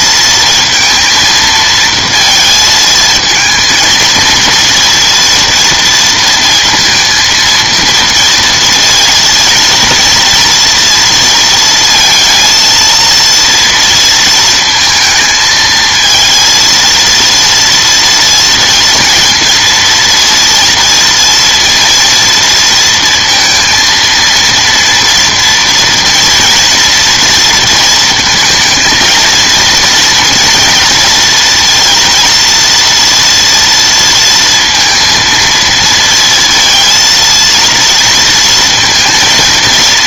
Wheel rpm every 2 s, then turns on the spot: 230, 230, 230, 230, 230, 230, 230, 220, 230, 230, 230, 230, 230, 230, 220, 230, 230, 230, 230, 230.
none